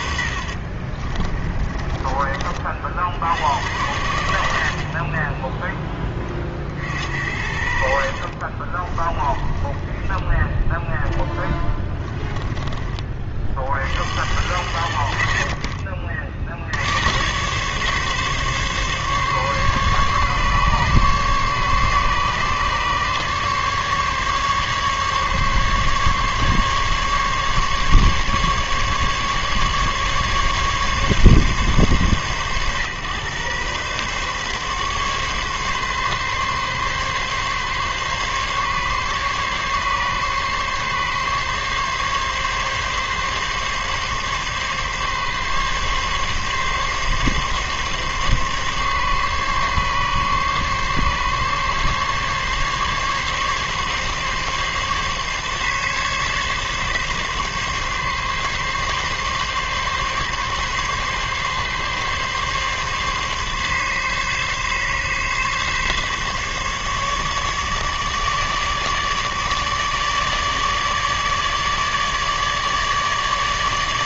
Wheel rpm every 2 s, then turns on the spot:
40, 40, 60, 40, 30, 0, 20, 60, 70, 140, 140, 140, 140, 140, 140, 140, 120, 140, 140, 140, 140, 140, 140, 140, 140, 140, 140, 140, 140, 140, 140, 140, 140, 150, 150, 150, 150.
0-2 8-10